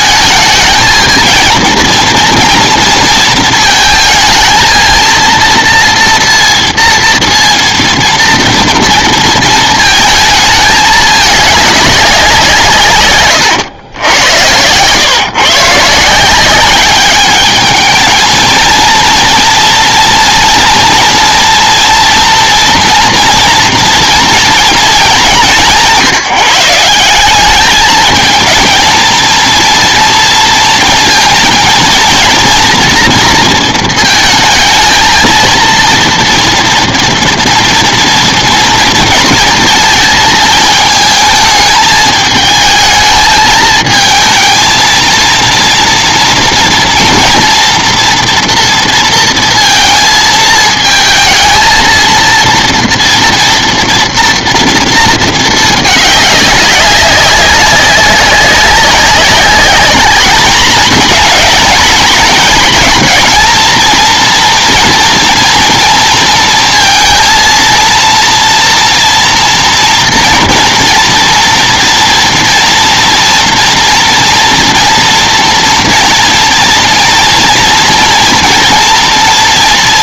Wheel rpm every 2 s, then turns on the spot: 220, 230, 230, 230, 230, 220, 170, 100, 190, 230, 230, 230, 230, 170, 230, 230, 230, 220, 230, 230, 220, 220, 220, 230, 230, 220, 230, 230, 200, 190, 220, 230, 230, 230, 240, 230, 230, 230, 230, 230.
none